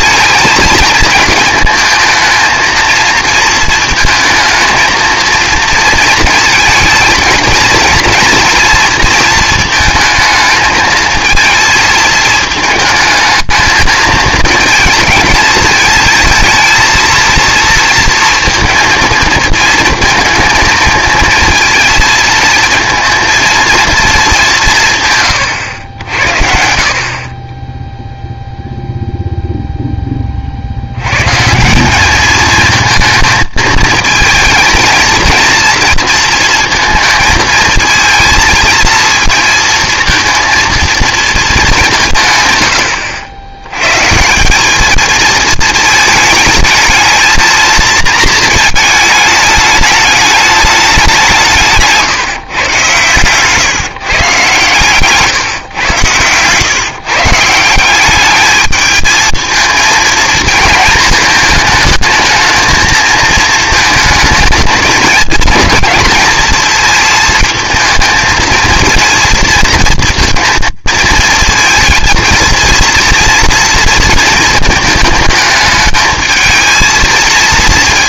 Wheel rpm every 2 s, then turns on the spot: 220, 230, 230, 230, 230, 220, 220, 230, 230, 230, 230, 230, 150, 60, 0, 80, 220, 220, 230, 230, 230, 100, 200, 220, 220, 200, 130, 130, 130, 210, 220, 220, 220, 220, 230, 220, 230, 230, 220.
none